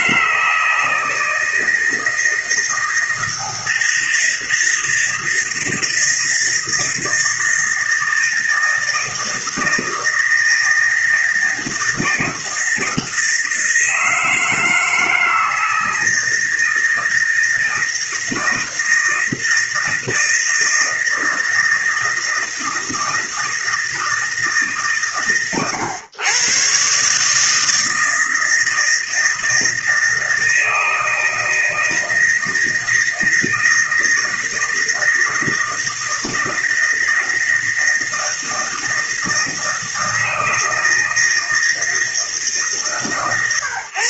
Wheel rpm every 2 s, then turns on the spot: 160, 160, 160, 160, 160, 160, 160, 160, 160, 160, 160, 160, 140, 130, 160, 160, 160, 160, 160, 160, 160, 160.
none